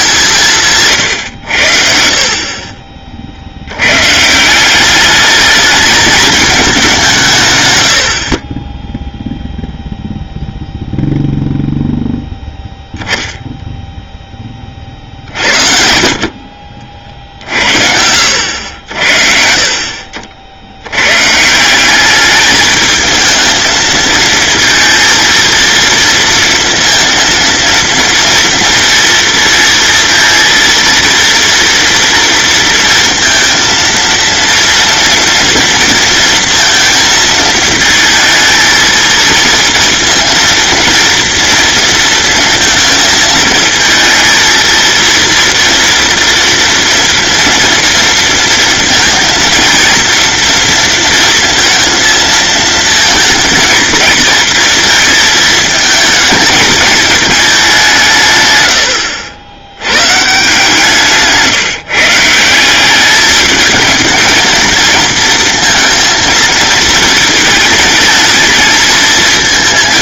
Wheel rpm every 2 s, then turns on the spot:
130, 50, 200, 170, 0, 0, 10, 50, 60, 60, 110, 220, 230, 230, 230, 230, 230, 230, 230, 230, 230, 230, 230, 240, 230, 230, 230, 220, 220, 80, 160, 190, 230, 220, 220.
none